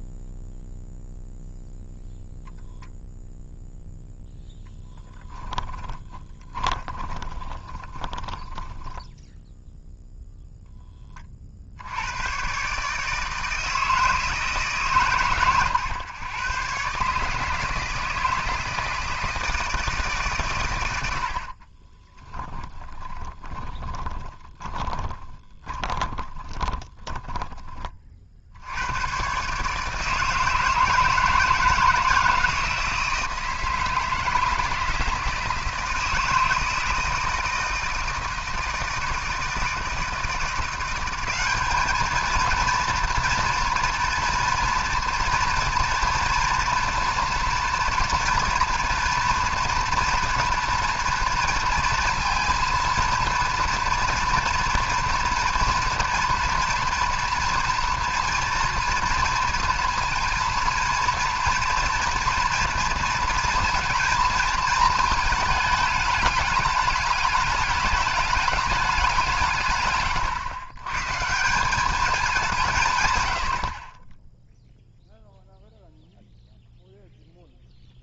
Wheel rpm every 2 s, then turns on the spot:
0, 0, 10, 20, 20, 0, 130, 140, 130, 160, 110, 10, 20, 10, 80, 160, 160, 160, 160, 160, 180, 230, 230, 230, 240, 230, 230, 240, 240, 230, 230, 230, 220, 210, 200, 120, 160, 0, 0.
6-10 22-28